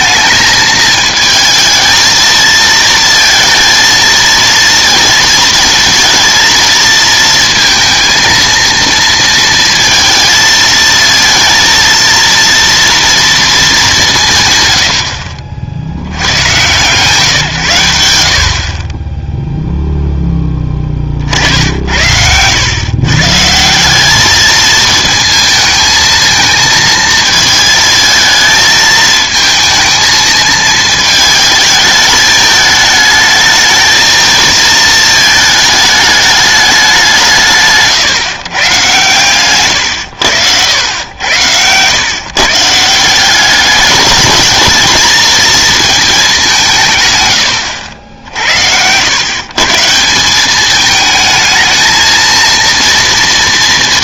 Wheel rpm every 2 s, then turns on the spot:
220, 230, 230, 230, 230, 220, 230, 120, 120, 40, 20, 120, 220, 220, 220, 220, 210, 220, 200, 140, 100, 160, 220, 180, 80, 200, 230.
none